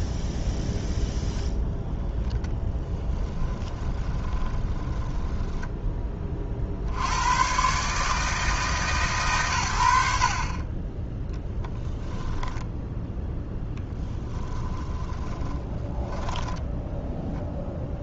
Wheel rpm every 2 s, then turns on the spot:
0, 10, 20, 60, 150, 20, 10, 40, 10.
2-6 12-16